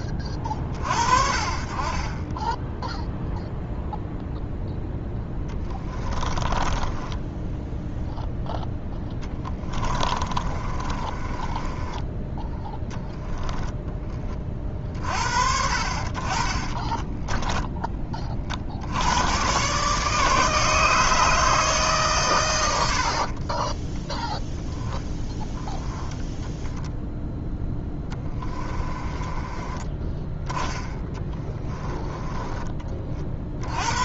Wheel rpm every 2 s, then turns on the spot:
40, 10, 0, 20, 0, 30, 10, 60, 30, 60, 150, 90, 0, 10, 20, 10, 20.
6-8 10-12 16-18 22-24 28-30